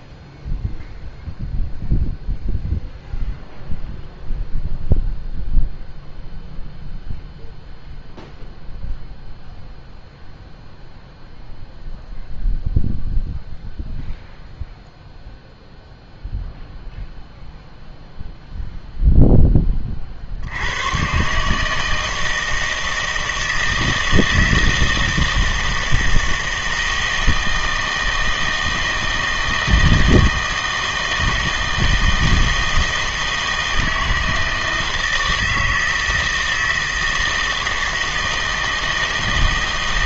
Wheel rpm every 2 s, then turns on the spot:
0, 0, 0, 0, 0, 0, 0, 0, 0, 0, 100, 160, 160, 160, 160, 160, 160, 160, 160, 160.
none